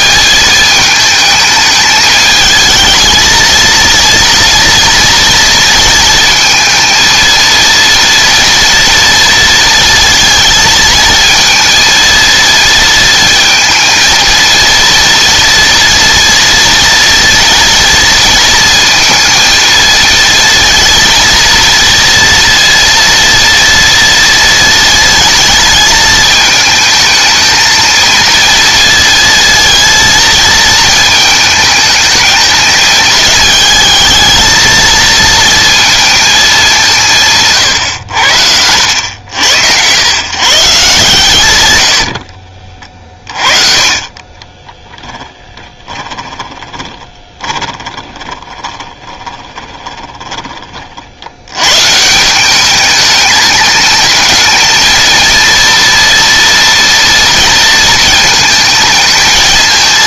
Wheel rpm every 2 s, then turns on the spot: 210, 220, 230, 220, 230, 220, 230, 230, 230, 230, 230, 230, 230, 220, 230, 220, 210, 220, 200, 80, 160, 40, 20, 20, 20, 30, 200, 220, 230, 220.
44-50